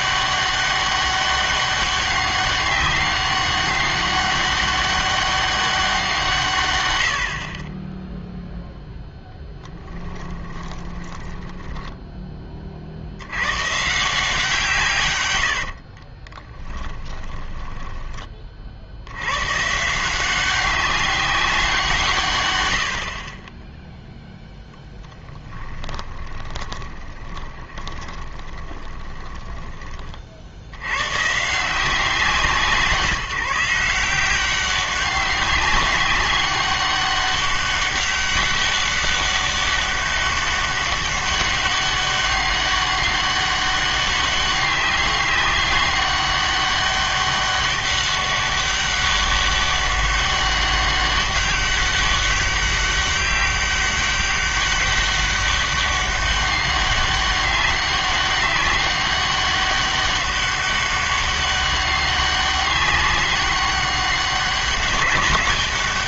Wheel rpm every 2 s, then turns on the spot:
200, 200, 200, 120, 0, 20, 30, 160, 20, 40, 190, 90, 0, 20, 20, 70, 170, 190, 200, 200, 200, 200, 200, 200, 200, 200, 200, 200, 200, 200, 200, 200, 200.
10-12 16-18 26-30